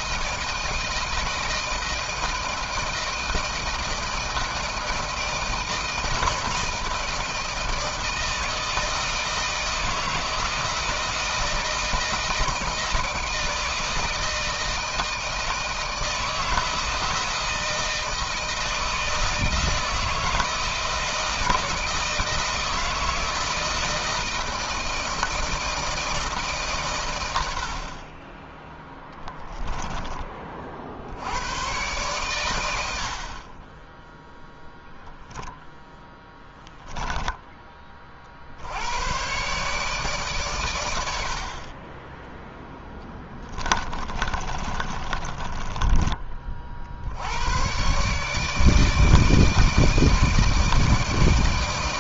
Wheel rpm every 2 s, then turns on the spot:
160, 160, 160, 160, 160, 160, 160, 160, 160, 160, 160, 160, 160, 140, 10, 50, 100, 0, 10, 70, 110, 10, 30, 50, 150, 160.
36-38 44-46